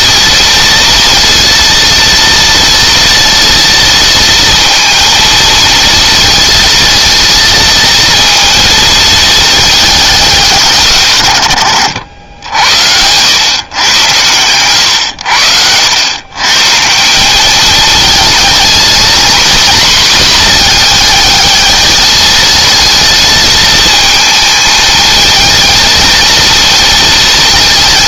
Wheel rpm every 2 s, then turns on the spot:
230, 230, 230, 230, 230, 160, 80, 110, 140, 230, 230, 220, 220, 230.
12-14